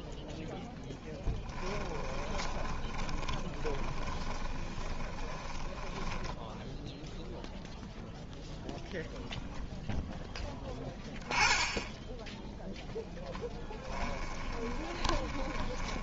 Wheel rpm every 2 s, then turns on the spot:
0, 10, 20, 0, 0, 0, 10, 20.
2-6 14-16